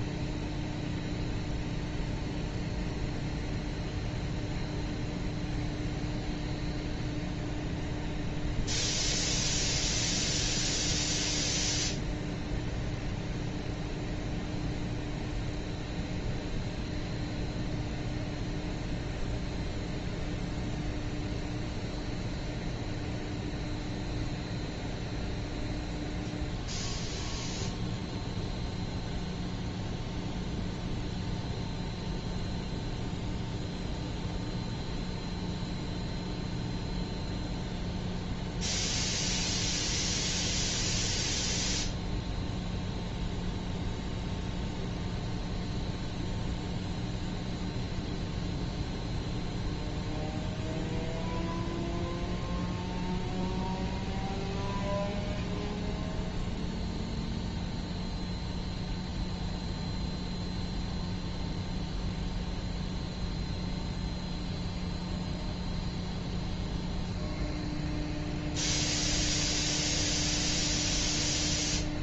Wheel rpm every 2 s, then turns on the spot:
0, 0, 0, 0, 0, 0, 0, 0, 0, 0, 0, 0, 0, 0, 0, 0, 0, 0, 0, 0, 0, 0, 0, 0, 0, 0, 0, 0, 0, 0, 0, 0, 0, 0, 0, 0.
none